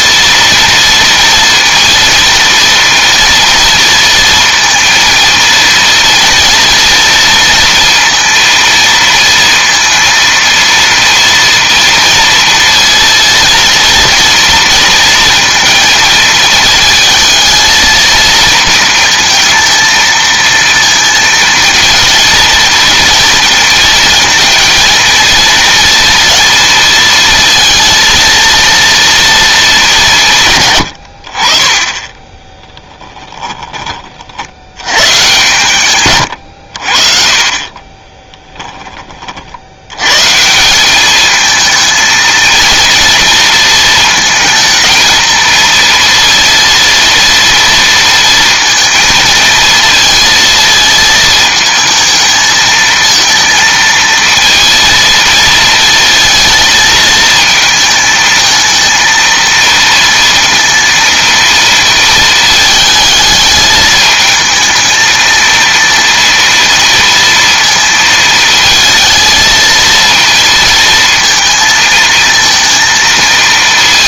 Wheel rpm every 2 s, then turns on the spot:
230, 230, 230, 230, 230, 230, 230, 230, 220, 230, 230, 230, 230, 230, 230, 120, 10, 80, 90, 20, 160, 230, 220, 230, 230, 230, 220, 230, 220, 220, 230, 220, 220, 230, 220, 230, 230.
32-34